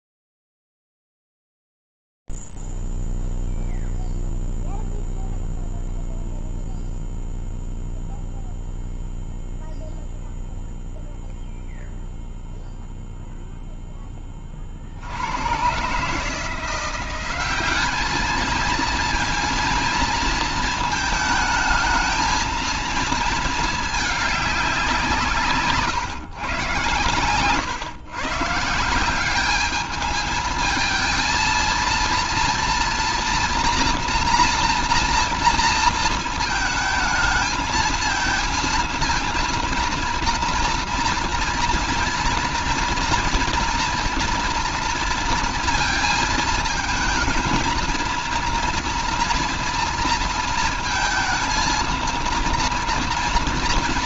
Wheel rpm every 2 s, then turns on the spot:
0, 0, 0, 0, 0, 0, 0, 10, 130, 200, 230, 220, 220, 150, 130, 210, 230, 230, 230, 230, 230, 230, 230, 220, 230, 230, 230.
none